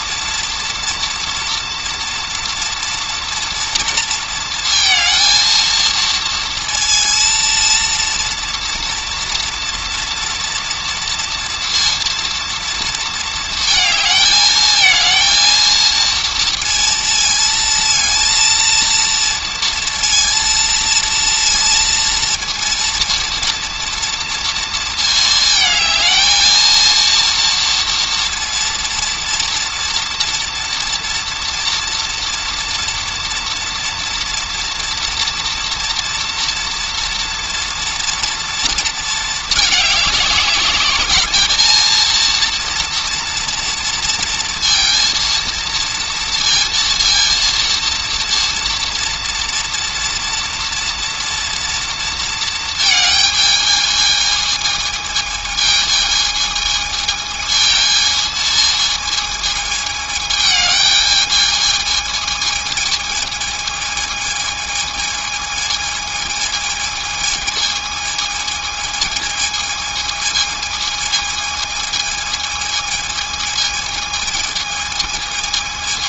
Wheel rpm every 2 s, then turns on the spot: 230, 230, 230, 230, 230, 230, 230, 220, 230, 230, 230, 230, 230, 230, 230, 230, 230, 230, 230, 230, 200, 230, 230, 230, 230, 230, 220, 220, 220, 220, 210, 220, 220, 220, 220, 220, 220, 220.
none